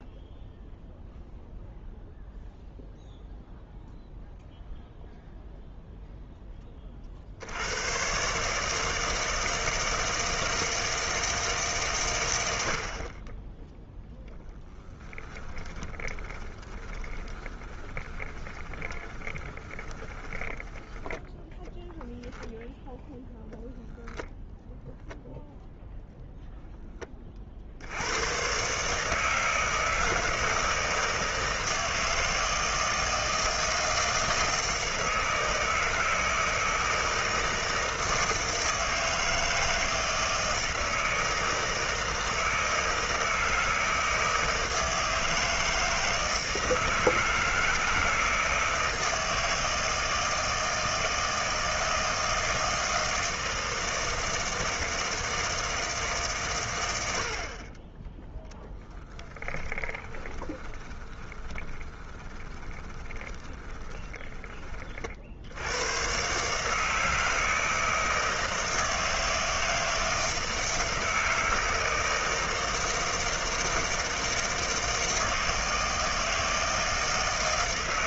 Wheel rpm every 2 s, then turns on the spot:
0, 0, 0, 20, 150, 160, 70, 30, 20, 20, 10, 0, 0, 0, 130, 160, 160, 160, 160, 160, 160, 160, 160, 160, 160, 160, 160, 160, 120, 10, 20, 20, 30, 150, 160, 160, 160, 160, 160.
14-20 58-64